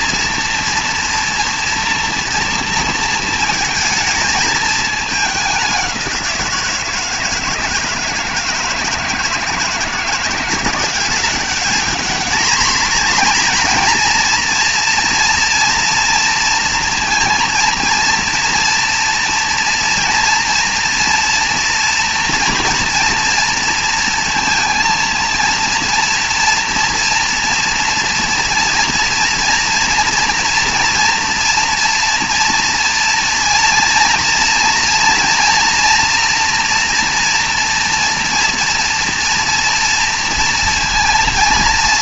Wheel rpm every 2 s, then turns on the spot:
230, 230, 210, 160, 160, 180, 230, 230, 230, 230, 230, 230, 230, 230, 230, 230, 230, 230, 240, 230, 230.
none